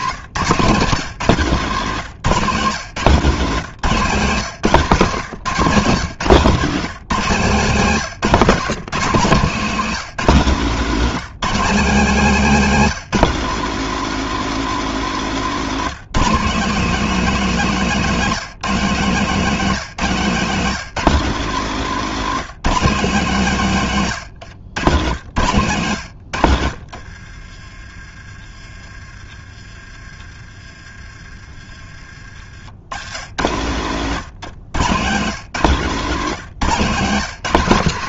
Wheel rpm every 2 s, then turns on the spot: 140, 160, 160, 170, 170, 180, 210, 220, 200, 200, 190, 200, 130, 70, 30, 30, 50, 120, 170.
24-26 34-36